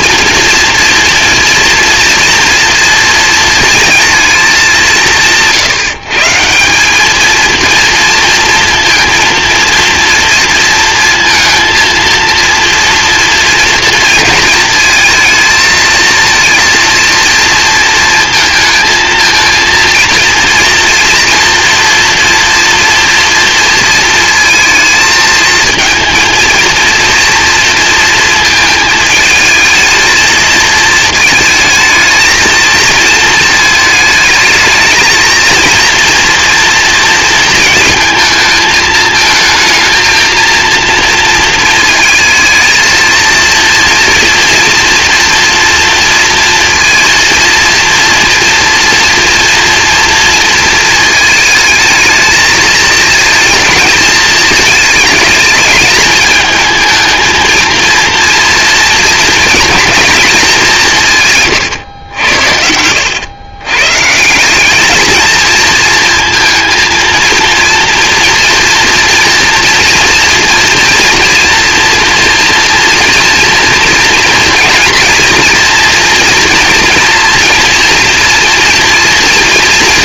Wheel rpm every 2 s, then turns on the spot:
230, 230, 190, 200, 230, 230, 230, 230, 230, 230, 230, 230, 220, 230, 220, 220, 220, 220, 230, 220, 230, 230, 230, 230, 230, 230, 230, 220, 220, 230, 160, 90, 220, 230, 230, 230, 230, 230, 230, 230.
none